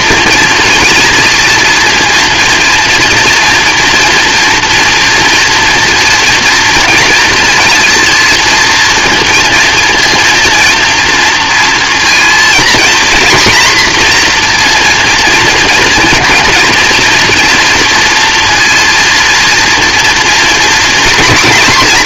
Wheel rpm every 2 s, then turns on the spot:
230, 230, 230, 230, 230, 230, 250, 240, 230, 230, 230.
none